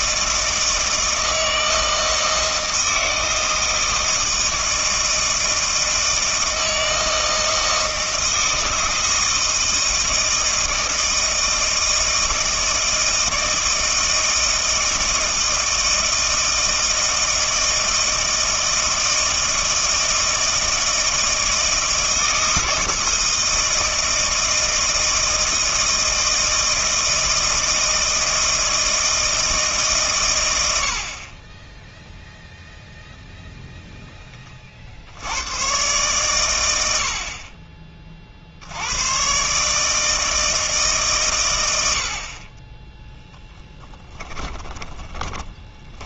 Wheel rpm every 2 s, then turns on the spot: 160, 160, 160, 160, 160, 160, 160, 160, 160, 160, 160, 160, 160, 160, 160, 90, 0, 40, 90, 80, 150, 10, 30.
44-46